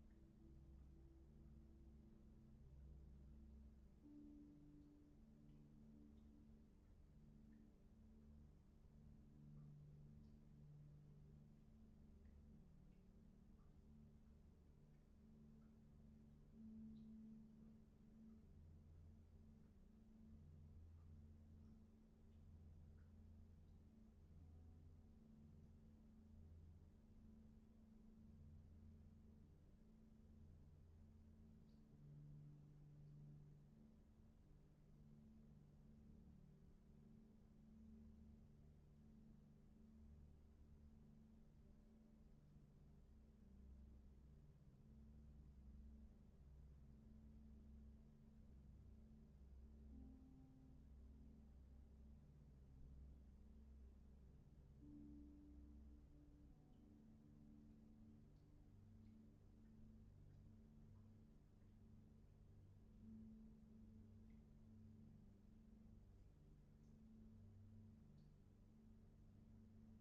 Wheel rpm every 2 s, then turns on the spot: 0, 0, 0, 0, 0, 0, 0, 0, 0, 0, 0, 0, 0, 0, 0, 0, 0, 0, 0, 0, 0, 0, 0, 0, 0, 0, 0, 0, 0, 0, 0, 0, 0, 0, 0.
none